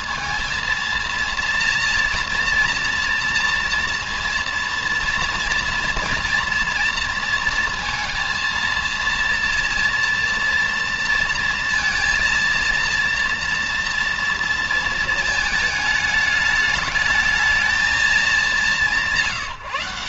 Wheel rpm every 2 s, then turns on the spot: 230, 230, 230, 230, 230, 230, 230, 230, 210, 200.
none